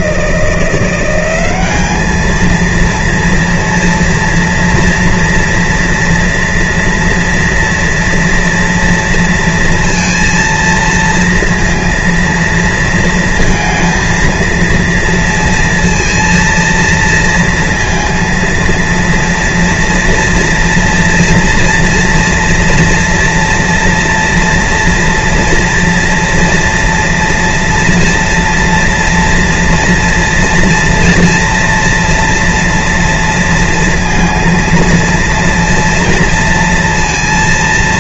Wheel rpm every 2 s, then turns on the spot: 170, 230, 230, 230, 230, 230, 230, 230, 230, 230, 230, 230, 230, 230, 230, 240, 240, 230, 230.
none